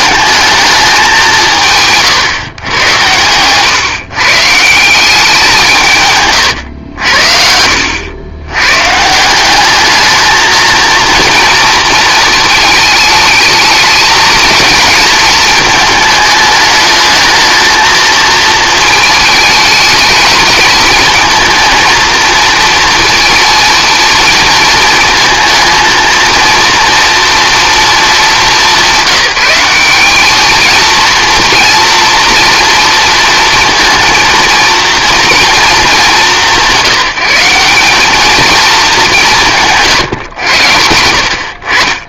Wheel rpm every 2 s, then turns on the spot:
210, 120, 170, 110, 110, 220, 220, 220, 210, 220, 220, 230, 230, 230, 200, 220, 230, 230, 180, 210, 90.
none